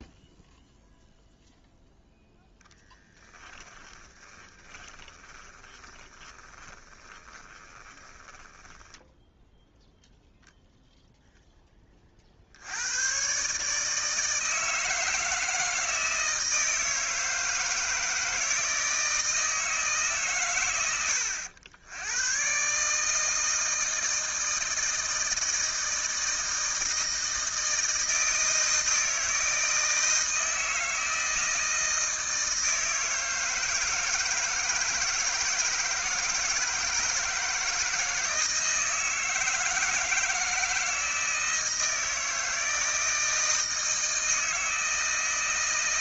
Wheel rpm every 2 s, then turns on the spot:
0, 0, 20, 20, 10, 0, 80, 160, 160, 160, 80, 130, 160, 160, 160, 160, 160, 160, 160, 160, 160, 160, 160.
4-10